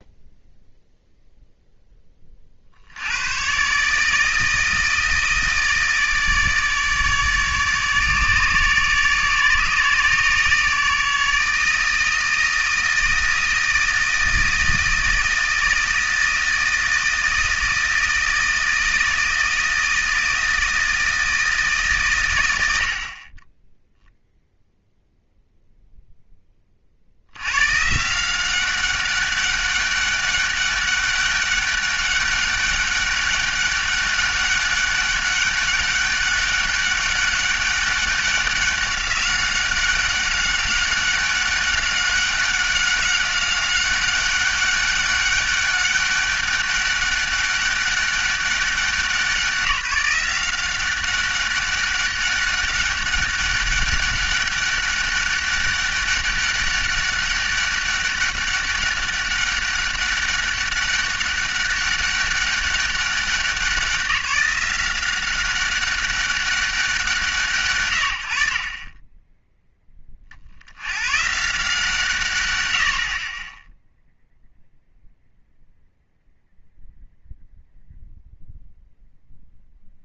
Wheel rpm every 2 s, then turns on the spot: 0, 50, 160, 150, 150, 150, 160, 160, 160, 160, 160, 80, 0, 20, 180, 200, 200, 200, 200, 190, 190, 200, 200, 200, 190, 190, 200, 200, 200, 200, 200, 200, 180, 180, 60, 50, 130, 0, 0, 0.
none